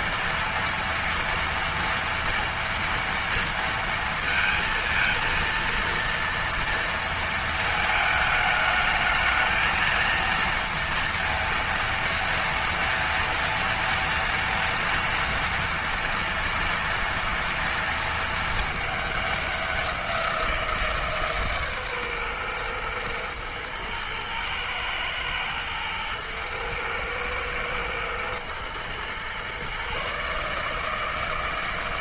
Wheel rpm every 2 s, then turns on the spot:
230, 230, 230, 230, 220, 230, 230, 230, 230, 230, 180, 130, 110, 110, 110, 140.
none